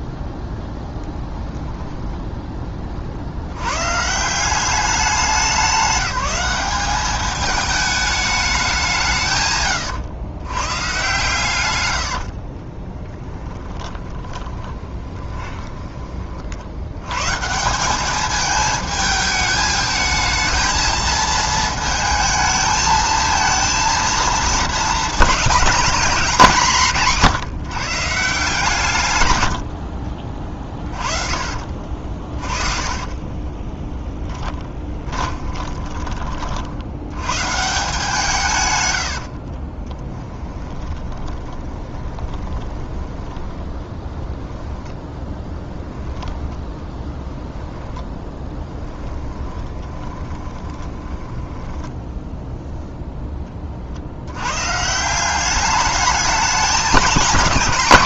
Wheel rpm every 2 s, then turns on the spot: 10, 40, 200, 210, 170, 130, 20, 20, 120, 220, 220, 220, 210, 180, 140, 30, 30, 20, 90, 110, 20, 20, 10, 10, 10, 20, 0, 150, 210.
12-16 30-36 38-42 46-52